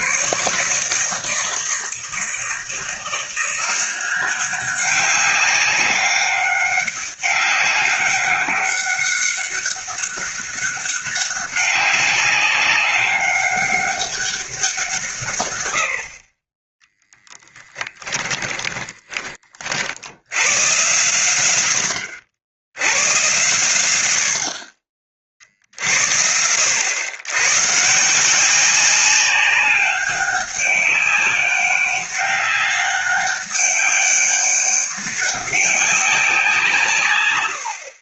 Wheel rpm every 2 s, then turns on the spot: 160, 170, 190, 200, 200, 200, 200, 170, 10, 30, 120, 100, 40, 90, 190, 200, 200, 200, 160.
18-20